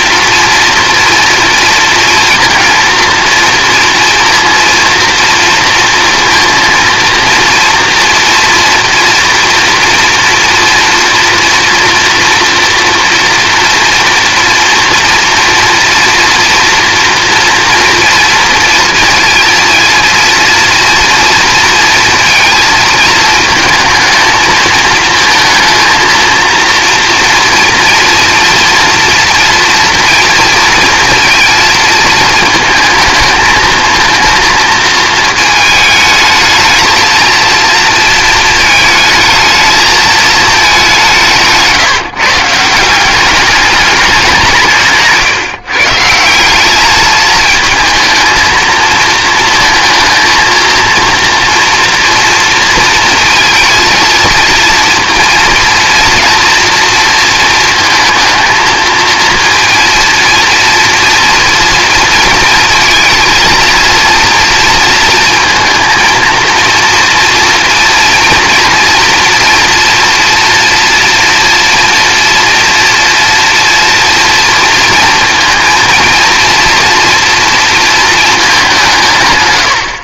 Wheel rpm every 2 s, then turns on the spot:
230, 230, 230, 230, 230, 230, 230, 240, 230, 230, 230, 230, 220, 230, 230, 230, 220, 230, 220, 220, 210, 170, 170, 190, 220, 230, 230, 230, 230, 230, 230, 230, 230, 230, 230, 230, 230, 230, 230, 200.
none